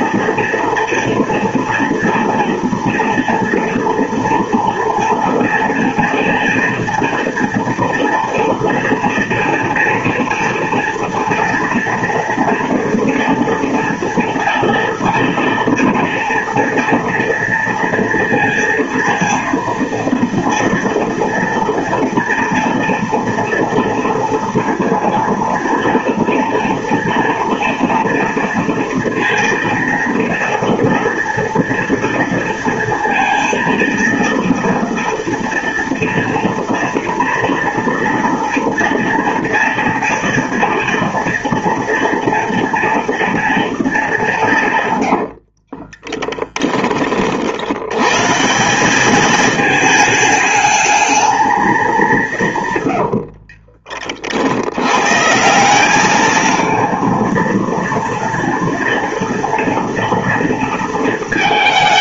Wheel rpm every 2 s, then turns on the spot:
230, 230, 230, 230, 230, 230, 230, 230, 230, 230, 230, 230, 230, 230, 230, 240, 230, 230, 240, 230, 230, 230, 110, 40, 200, 220, 80, 140, 230, 230, 230.
44-46 52-54